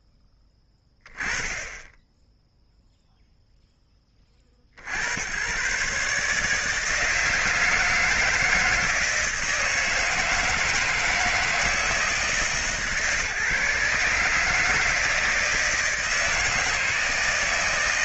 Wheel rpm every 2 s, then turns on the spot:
10, 0, 50, 160, 160, 160, 150, 150, 160.
none